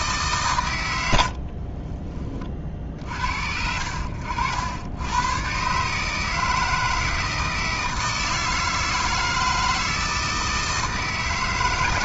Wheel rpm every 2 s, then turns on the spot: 120, 40, 80, 160, 160, 160.
none